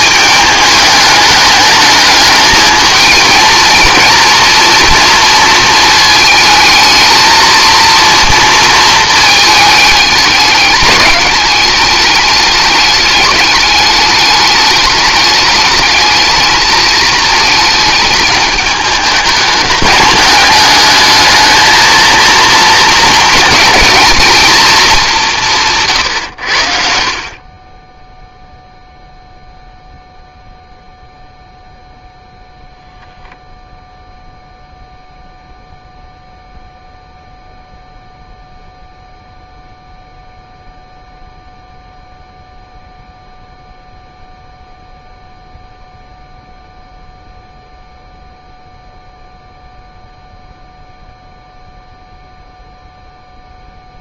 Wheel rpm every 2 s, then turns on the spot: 210, 210, 230, 220, 230, 210, 210, 210, 220, 210, 210, 230, 230, 110, 0, 0, 0, 0, 0, 0, 0, 0, 0, 0, 0, 0, 0.
none